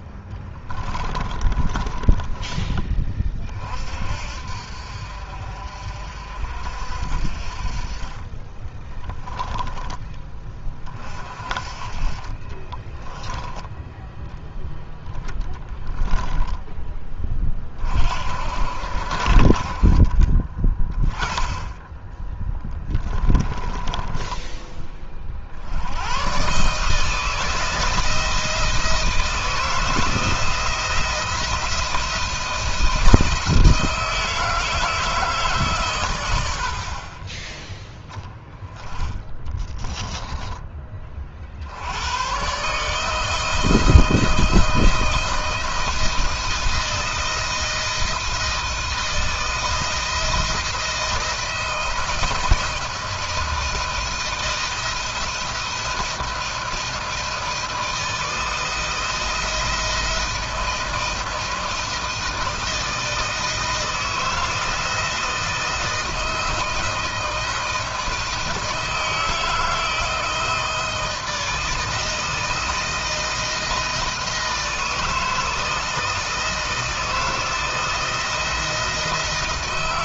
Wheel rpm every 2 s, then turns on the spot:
30, 30, 50, 50, 20, 40, 20, 10, 20, 60, 10, 30, 30, 150, 160, 170, 170, 160, 60, 10, 30, 150, 160, 160, 160, 170, 170, 170, 160, 160, 170, 160, 160, 160, 160, 160, 160, 160, 160, 170.
0-2 8-10 12-14 22-24